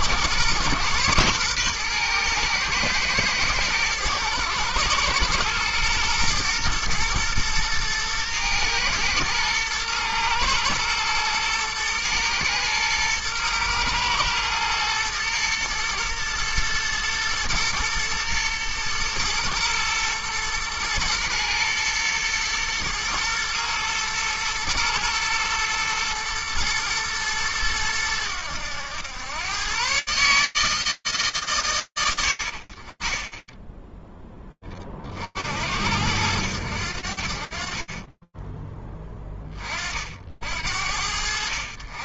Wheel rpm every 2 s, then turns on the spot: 120, 110, 110, 120, 120, 120, 120, 120, 110, 110, 110, 120, 110, 110, 120, 90, 0, 50, 60, 20, 80.
none